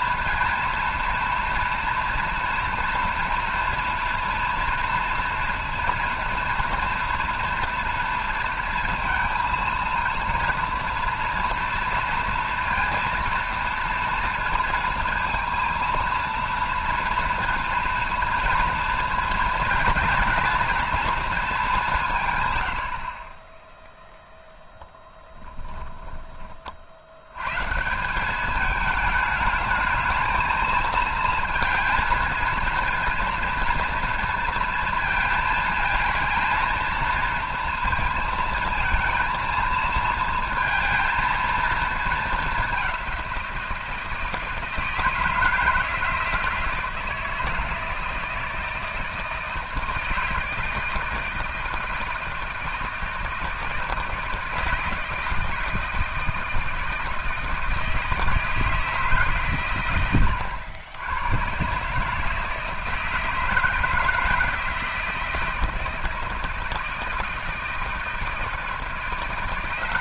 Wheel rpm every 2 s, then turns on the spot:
230, 240, 230, 230, 230, 230, 230, 230, 230, 230, 230, 40, 10, 80, 210, 220, 230, 220, 230, 230, 230, 190, 160, 160, 160, 160, 160, 160, 160, 150, 110, 160, 160, 160, 170.
24-26